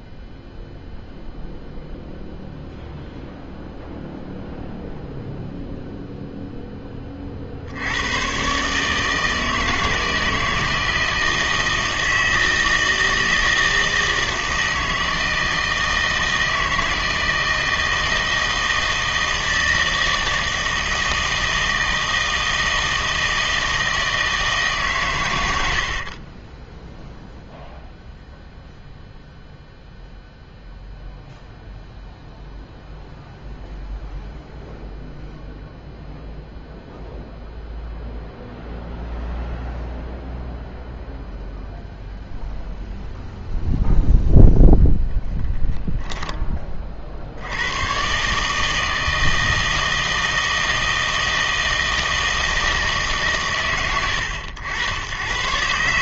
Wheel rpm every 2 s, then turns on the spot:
0, 0, 0, 10, 130, 160, 160, 160, 160, 160, 160, 160, 150, 10, 0, 0, 0, 0, 0, 0, 0, 0, 0, 30, 150, 160, 160, 90.
26-28